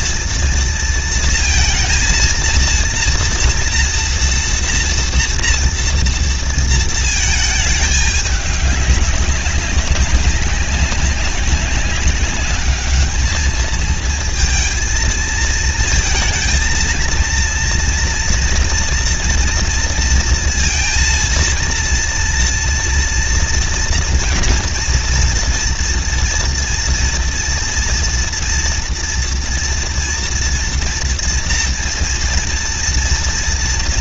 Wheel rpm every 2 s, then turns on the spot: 230, 230, 230, 230, 200, 190, 200, 230, 230, 230, 230, 230, 230, 230, 230, 230, 230.
none